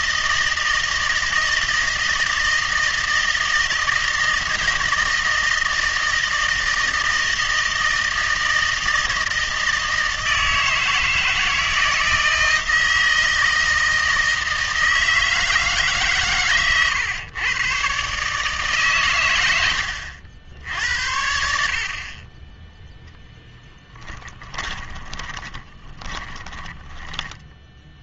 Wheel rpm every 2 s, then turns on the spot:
160, 160, 160, 160, 160, 160, 160, 160, 120, 140, 80, 0, 10, 10.
24-28